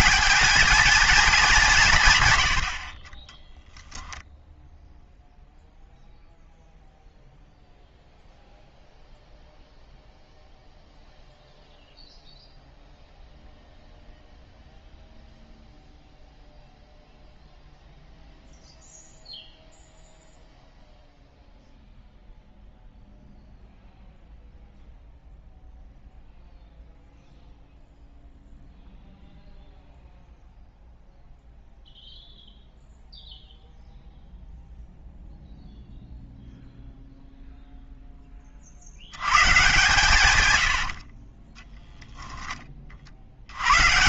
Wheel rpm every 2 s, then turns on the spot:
210, 70, 0, 0, 0, 0, 0, 0, 0, 0, 0, 0, 0, 0, 0, 0, 0, 0, 0, 40, 100, 20.
40-42